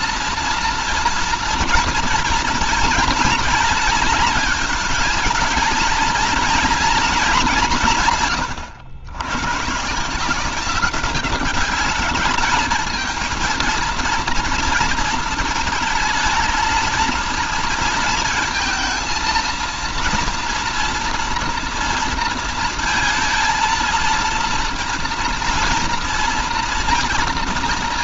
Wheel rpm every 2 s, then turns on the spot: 230, 230, 230, 230, 110, 180, 210, 230, 220, 220, 240, 230, 230, 230.
none